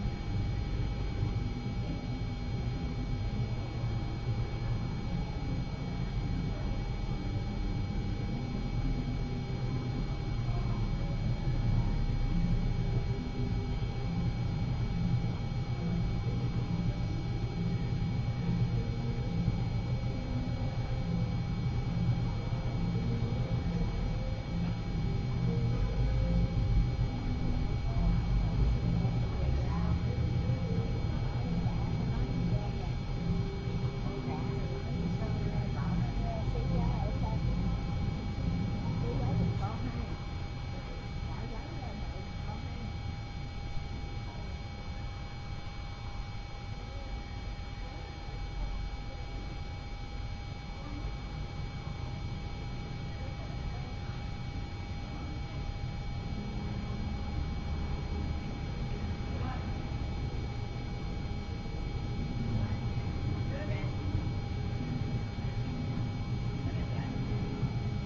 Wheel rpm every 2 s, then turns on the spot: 0, 0, 0, 0, 0, 0, 0, 0, 0, 0, 0, 0, 0, 0, 0, 0, 0, 0, 0, 0, 0, 0, 0, 0, 0, 0, 0, 0, 0, 0, 0, 0, 0, 0.
none